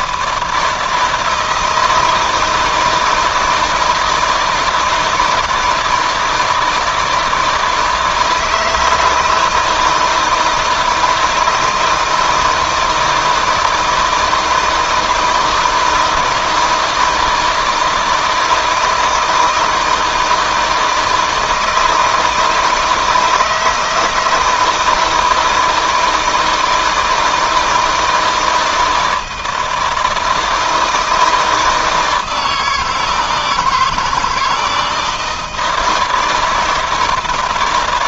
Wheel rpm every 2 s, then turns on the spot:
160, 160, 160, 160, 160, 160, 160, 160, 160, 160, 160, 160, 160, 160, 160, 160, 170, 160, 160.
none